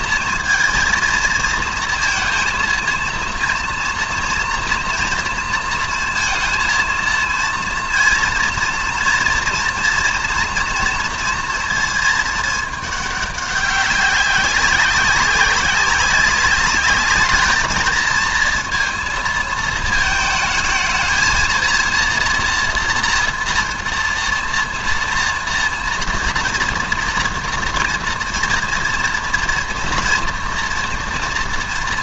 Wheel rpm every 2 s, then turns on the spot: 230, 230, 240, 230, 230, 240, 210, 200, 200, 230, 220, 240, 230, 230, 230, 240.
none